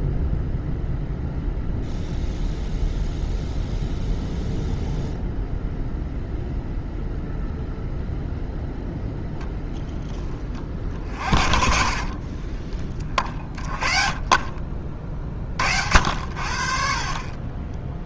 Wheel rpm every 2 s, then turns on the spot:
0, 0, 0, 0, 10, 50, 40, 40, 60.
12-14 16-18